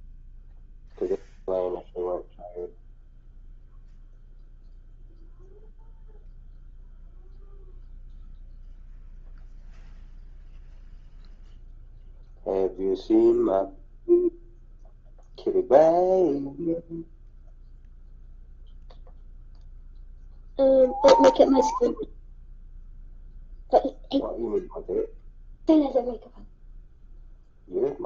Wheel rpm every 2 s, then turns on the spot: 0, 0, 0, 0, 0, 0, 0, 0, 0, 0, 0, 0, 0, 0.
none